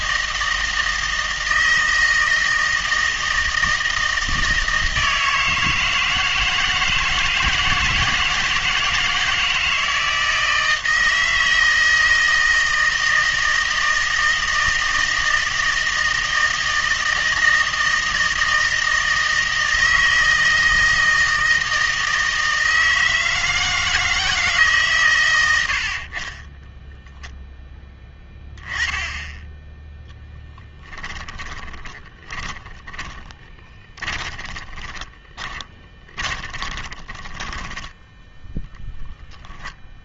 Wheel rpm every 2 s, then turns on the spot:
160, 160, 160, 160, 160, 160, 160, 160, 160, 160, 160, 160, 140, 10, 10, 10, 20, 20, 20, 0.
26-28 30-38